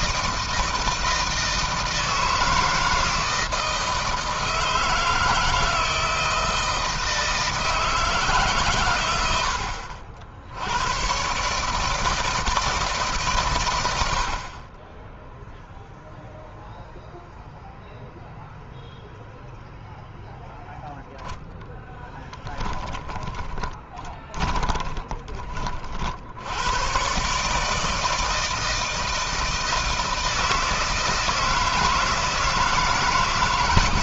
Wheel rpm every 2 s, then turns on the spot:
160, 160, 160, 160, 140, 90, 150, 30, 0, 0, 0, 10, 20, 90, 160, 160, 160.
22-26